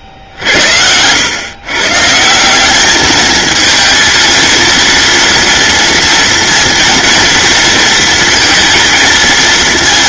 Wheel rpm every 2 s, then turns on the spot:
80, 190, 230, 230, 220.
none